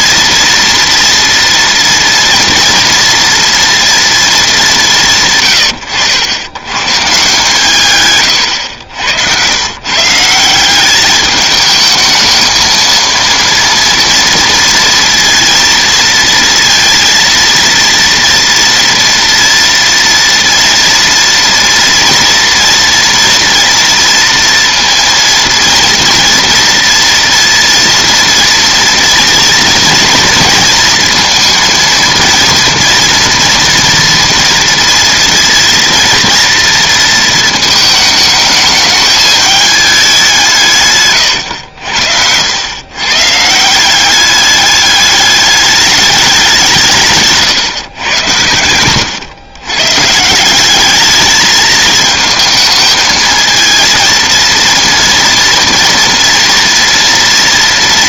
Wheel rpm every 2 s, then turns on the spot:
230, 230, 210, 110, 110, 190, 220, 230, 230, 230, 230, 230, 230, 230, 230, 230, 230, 230, 230, 210, 160, 100, 200, 170, 100, 190, 220, 230, 240.
8-10 48-50